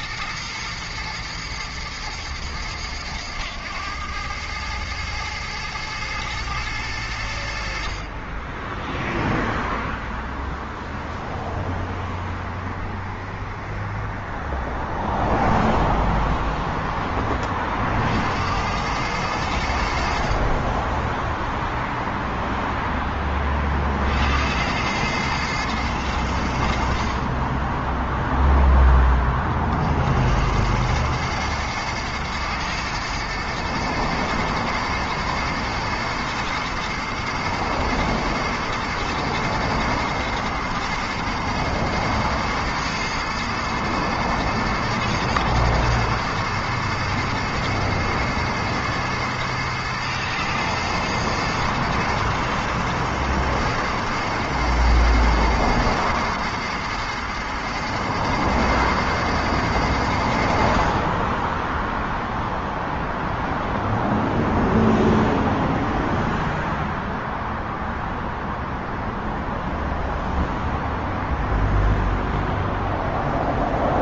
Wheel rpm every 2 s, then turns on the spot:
120, 110, 110, 110, 10, 0, 0, 0, 0, 100, 10, 0, 100, 60, 10, 100, 110, 120, 110, 110, 110, 110, 110, 110, 110, 110, 110, 110, 110, 110, 50, 0, 0, 0, 0, 0, 0.
none